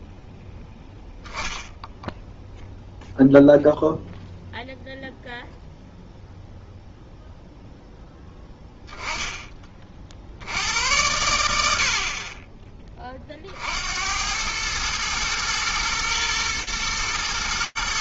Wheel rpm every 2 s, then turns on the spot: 0, 0, 0, 10, 90, 30, 110, 120, 130.
none